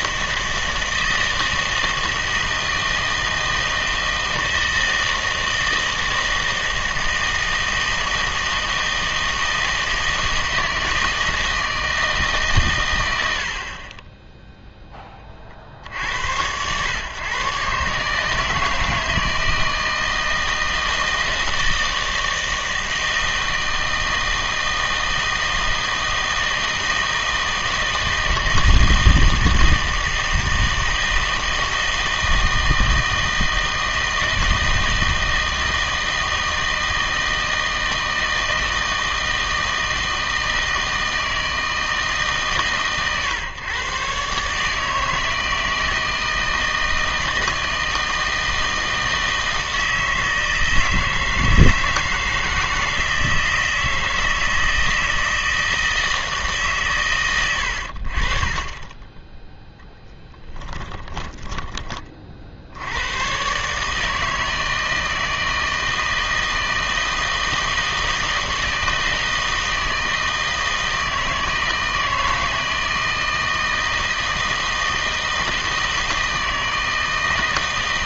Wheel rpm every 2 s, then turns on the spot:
160, 160, 160, 160, 160, 160, 130, 0, 110, 160, 160, 160, 160, 160, 160, 160, 160, 160, 160, 160, 160, 140, 150, 160, 160, 160, 160, 160, 150, 30, 20, 70, 160, 160, 160, 160, 160, 160, 160.
58-62